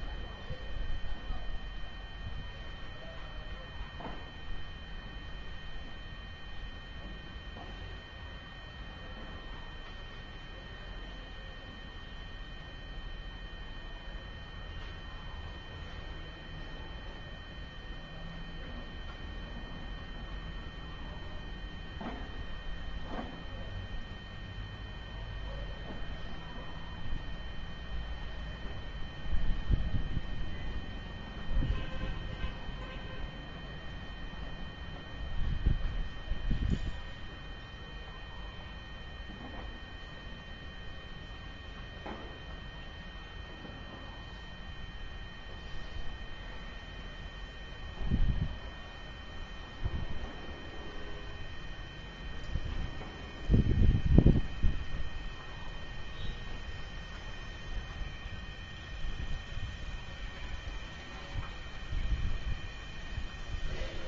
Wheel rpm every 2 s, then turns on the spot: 0, 0, 0, 0, 0, 0, 0, 0, 0, 0, 0, 0, 0, 0, 0, 0, 0, 0, 0, 0, 0, 0, 0, 0, 0, 0, 0, 0, 0, 0, 0, 0.
none